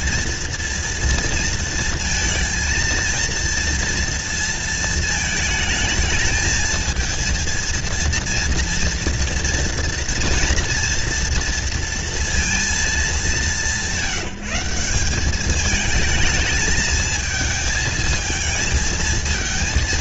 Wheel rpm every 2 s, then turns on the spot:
230, 230, 230, 220, 230, 240, 220, 160, 220, 220.
none